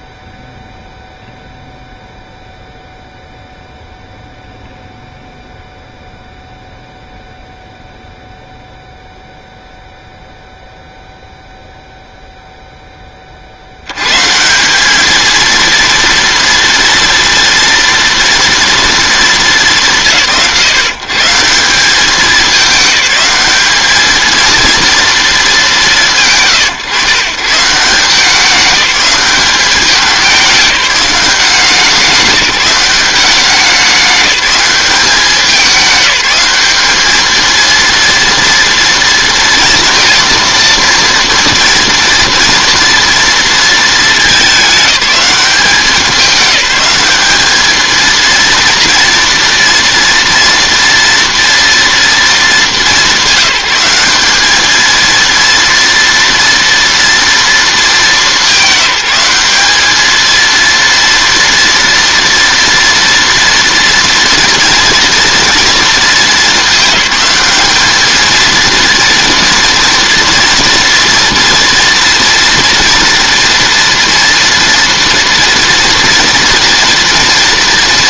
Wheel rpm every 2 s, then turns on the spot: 0, 0, 0, 0, 0, 0, 10, 200, 230, 230, 160, 210, 230, 130, 200, 190, 190, 200, 200, 230, 230, 230, 210, 200, 230, 230, 210, 220, 230, 200, 230, 230, 230, 210, 230, 230, 230, 230, 230.
none